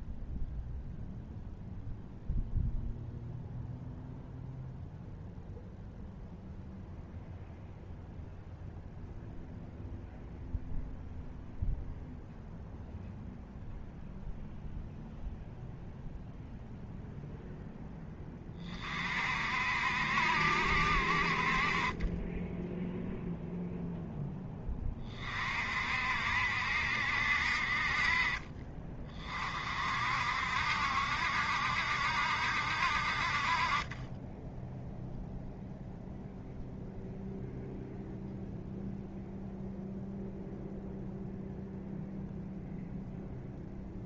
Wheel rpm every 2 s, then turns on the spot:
0, 0, 0, 0, 0, 0, 0, 0, 0, 30, 60, 0, 20, 70, 30, 60, 60, 0, 0, 0, 0, 0.
none